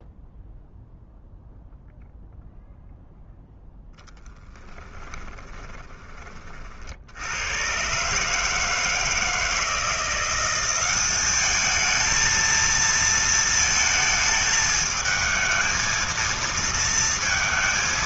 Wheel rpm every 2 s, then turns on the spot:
0, 0, 20, 50, 160, 190, 230, 220, 230.
4-6